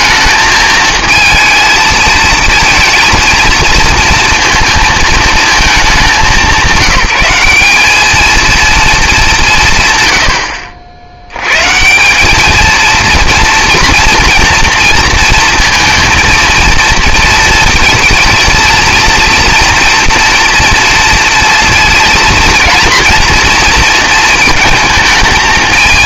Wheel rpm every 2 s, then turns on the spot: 220, 230, 230, 190, 220, 70, 220, 230, 230, 230, 230, 230, 220.
none